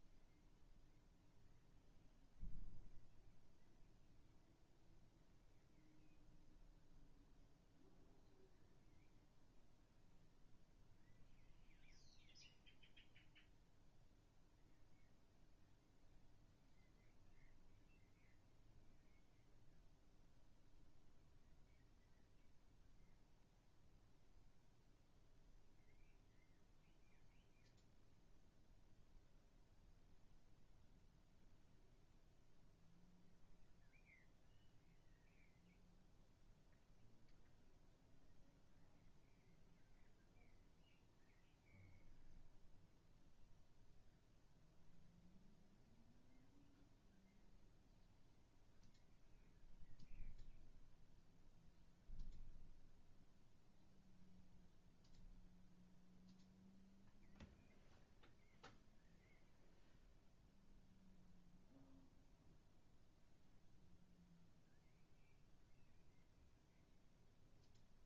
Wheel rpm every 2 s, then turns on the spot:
0, 0, 0, 0, 0, 0, 0, 0, 0, 0, 0, 0, 0, 0, 0, 0, 0, 0, 0, 0, 0, 0, 0, 0, 0, 0, 0, 0, 0, 0, 0, 0, 0, 0.
none